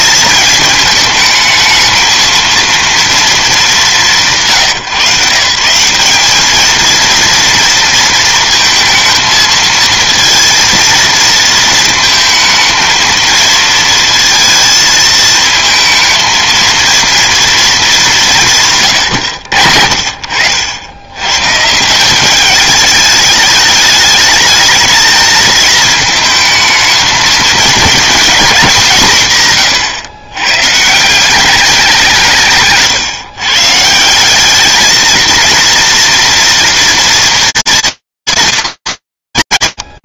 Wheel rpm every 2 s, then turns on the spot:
220, 230, 170, 210, 220, 230, 220, 230, 230, 160, 80, 210, 220, 220, 220, 130, 160, 200, 230, 230.
none